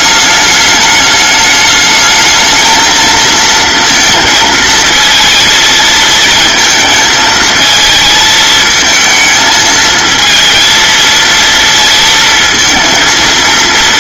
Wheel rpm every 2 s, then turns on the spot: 210, 220, 220, 220, 220, 230, 230.
none